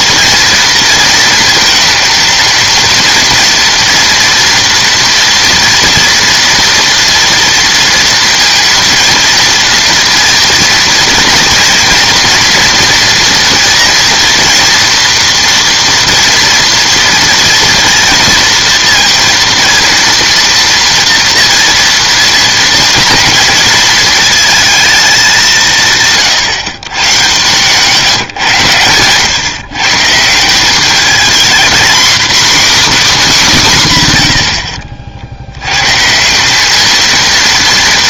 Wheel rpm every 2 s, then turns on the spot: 230, 230, 240, 230, 230, 230, 230, 230, 230, 230, 230, 230, 220, 130, 130, 190, 280, 70, 210.
none